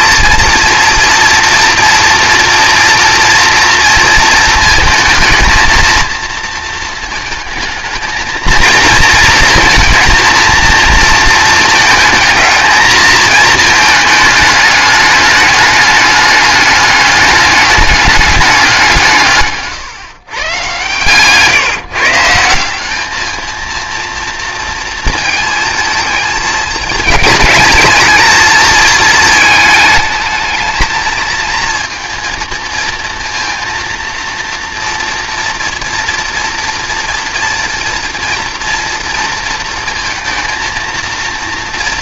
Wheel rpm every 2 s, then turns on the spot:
230, 230, 220, 230, 230, 230, 220, 210, 210, 190, 120, 180, 230, 220, 220, 220, 230, 230, 230, 230, 230.
none